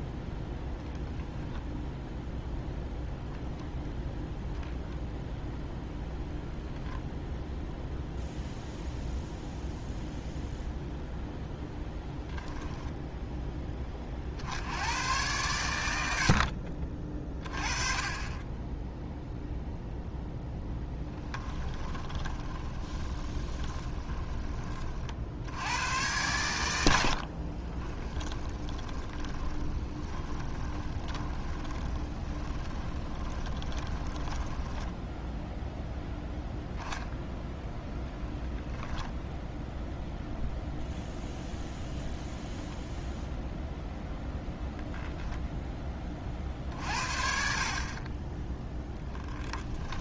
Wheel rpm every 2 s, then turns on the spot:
0, 0, 0, 0, 0, 0, 10, 90, 40, 10, 10, 20, 30, 80, 20, 20, 20, 10, 0, 0, 0, 0, 10, 60, 0.
12-14 20-24 26-36